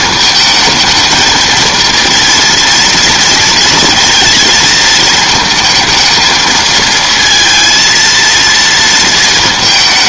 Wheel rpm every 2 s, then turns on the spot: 220, 230, 220, 220, 230.
none